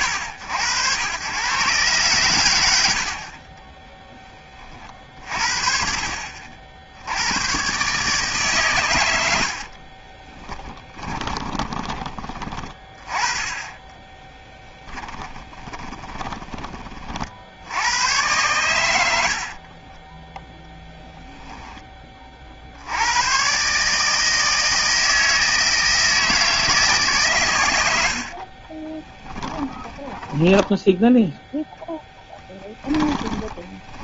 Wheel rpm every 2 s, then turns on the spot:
100, 70, 50, 80, 90, 20, 20, 10, 30, 90, 0, 70, 160, 150, 20, 10, 10.
10-12 14-16 28-34